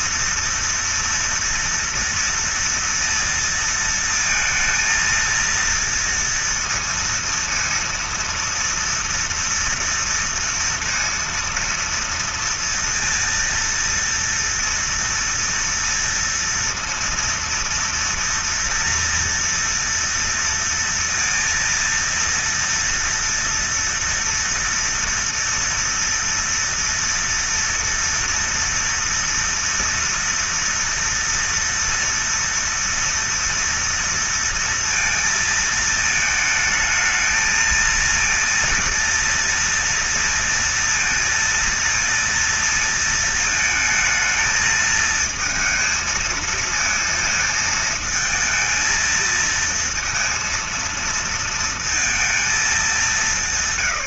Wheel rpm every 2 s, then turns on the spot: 230, 230, 230, 230, 230, 230, 230, 230, 230, 230, 230, 230, 230, 230, 230, 230, 230, 230, 220, 230, 230, 230, 220, 220, 220, 230, 230.
none